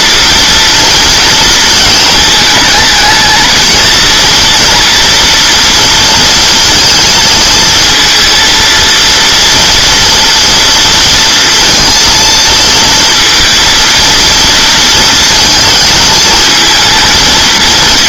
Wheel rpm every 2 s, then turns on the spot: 230, 220, 230, 230, 230, 230, 230, 230, 230.
none